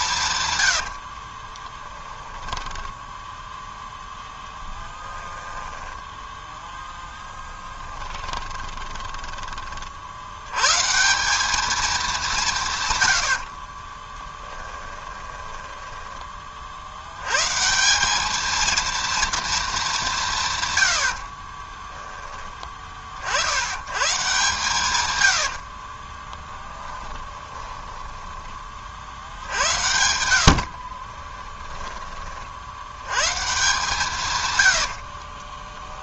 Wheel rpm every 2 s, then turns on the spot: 100, 10, 10, 10, 30, 130, 140, 10, 50, 230, 130, 40, 130, 20, 30, 50, 80, 90.
0-6 8-10 14-16 26-28 30-32 34-36